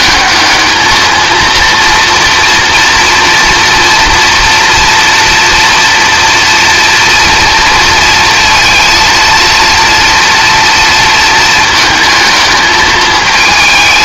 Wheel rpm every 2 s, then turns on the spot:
220, 230, 240, 230, 230, 230, 220.
none